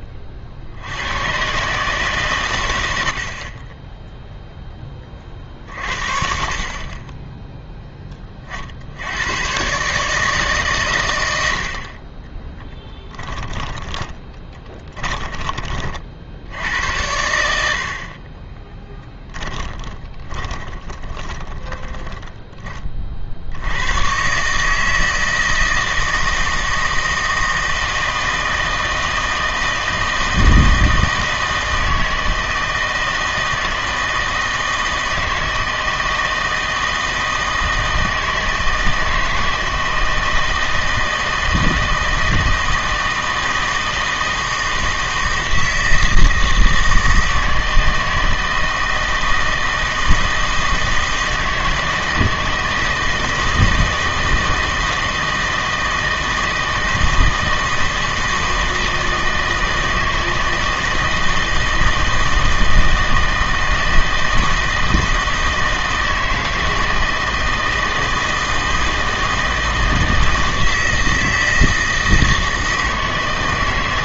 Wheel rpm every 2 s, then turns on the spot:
60, 100, 10, 50, 40, 140, 20, 20, 90, 20, 20, 20, 150, 160, 160, 160, 160, 160, 160, 160, 160, 160, 160, 160, 160, 160, 160, 160, 160, 160, 160, 160, 160, 160, 160, 160, 160.
12-16 18-22